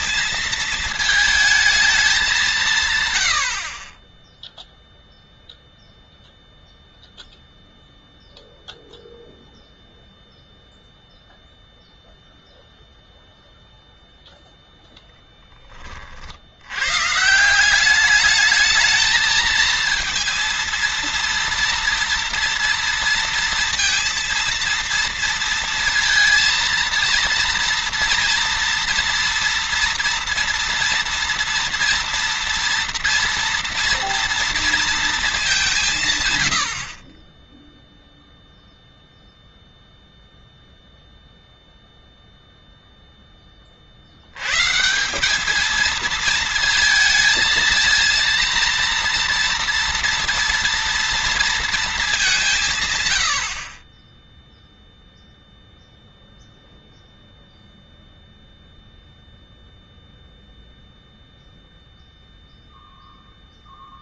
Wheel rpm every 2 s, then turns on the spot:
230, 190, 10, 0, 0, 0, 0, 0, 70, 210, 230, 230, 230, 230, 230, 230, 230, 230, 120, 0, 0, 0, 100, 220, 230, 230, 170, 0, 0, 0, 0, 0.
none